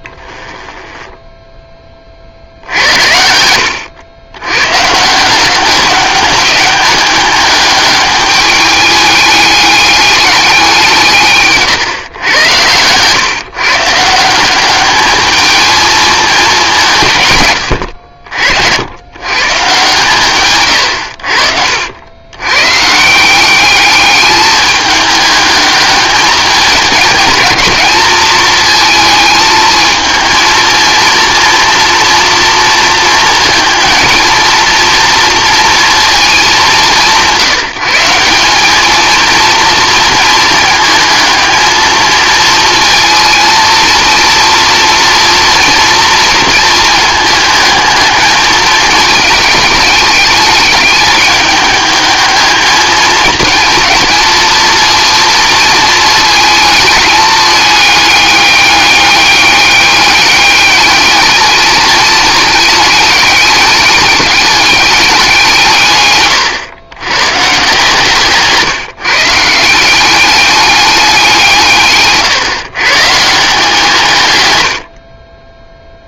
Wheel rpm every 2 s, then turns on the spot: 10, 70, 140, 200, 210, 180, 110, 210, 160, 90, 100, 140, 210, 220, 220, 230, 230, 230, 190, 220, 220, 230, 230, 230, 210, 210, 220, 230, 220, 200, 210, 210, 200, 110, 160, 200, 150, 80.
0-2